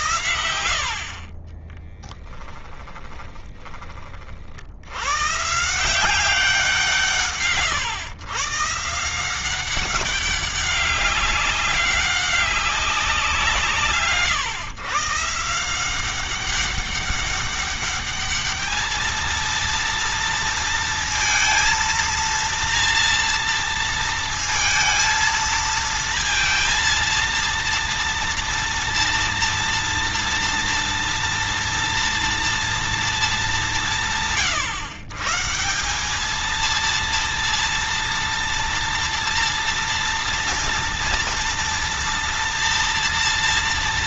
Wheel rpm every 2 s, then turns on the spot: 60, 20, 100, 140, 150, 200, 190, 140, 200, 220, 230, 230, 220, 230, 230, 230, 230, 130, 230, 230, 230, 240.
2-4